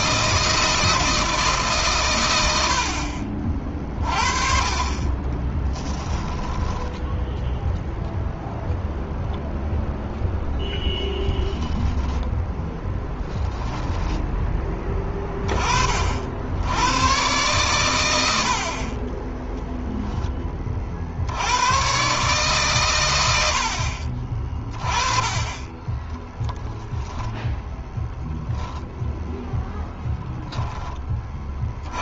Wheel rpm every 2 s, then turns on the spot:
160, 60, 30, 10, 0, 10, 10, 10, 100, 30, 50, 120, 30, 10, 0, 20.
4-8 12-14